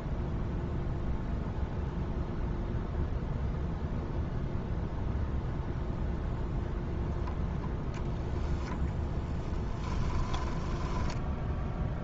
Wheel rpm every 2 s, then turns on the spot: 0, 0, 0, 0, 10, 10.
10-12